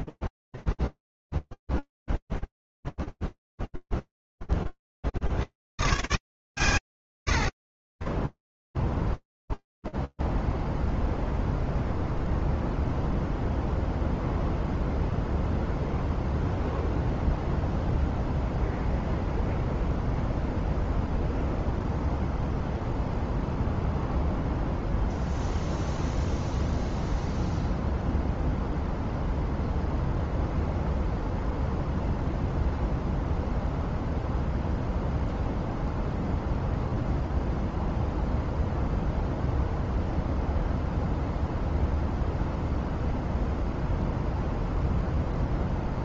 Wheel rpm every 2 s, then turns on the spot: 0, 0, 60, 120, 0, 0, 0, 0, 0, 0, 0, 0, 0, 0, 0, 0, 0, 0, 0, 0, 0, 0, 0.
none